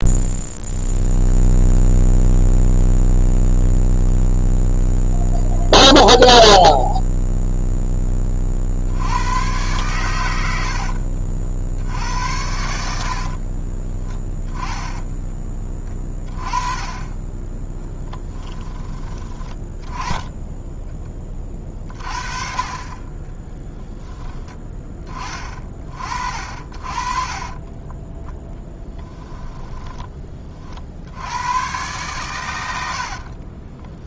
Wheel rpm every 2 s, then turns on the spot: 0, 0, 0, 0, 50, 70, 70, 20, 20, 10, 10, 30, 20, 40, 10, 50, 80.
10-12 28-30